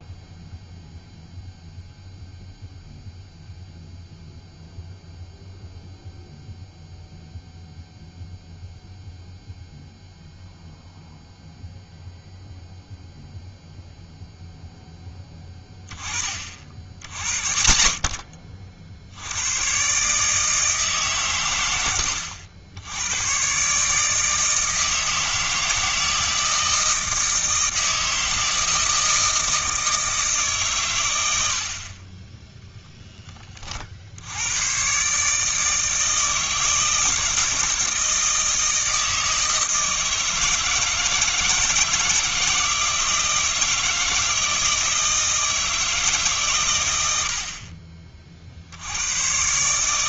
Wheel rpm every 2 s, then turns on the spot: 0, 0, 0, 0, 0, 0, 0, 0, 70, 60, 150, 90, 160, 160, 160, 130, 0, 130, 160, 160, 160, 170, 160, 100, 70.
none